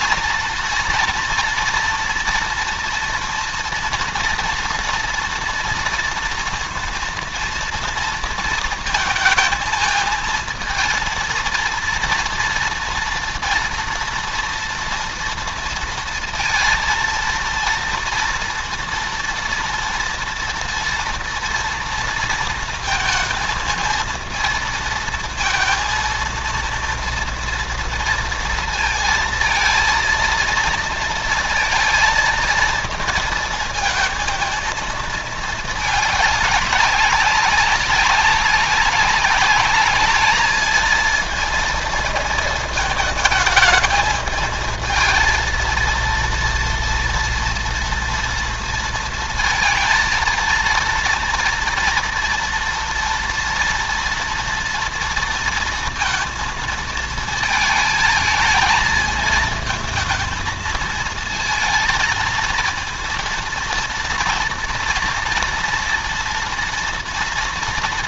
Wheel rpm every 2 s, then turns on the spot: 230, 240, 230, 230, 230, 230, 230, 230, 230, 230, 230, 230, 220, 230, 230, 220, 230, 220, 200, 200, 220, 220, 220, 230, 230, 230, 240, 230, 220, 220, 230, 230, 230, 230.
none